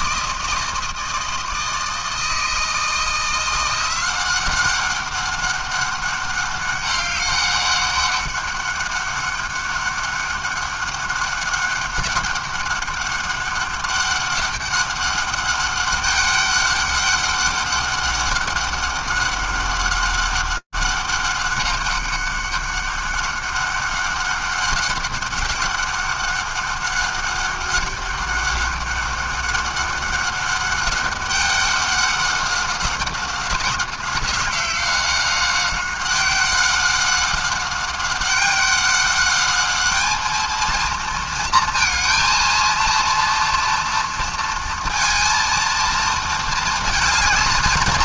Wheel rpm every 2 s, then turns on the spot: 160, 160, 190, 190, 200, 200, 200, 200, 200, 200, 200, 200, 200, 200, 200, 200, 190, 190, 190, 190, 220, 230, 230, 220.
none